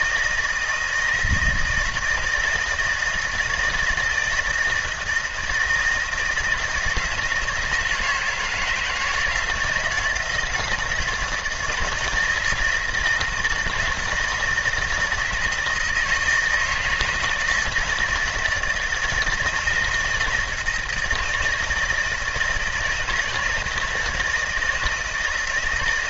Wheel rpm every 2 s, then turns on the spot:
160, 160, 160, 170, 160, 170, 160, 160, 160, 160, 160, 160, 160.
none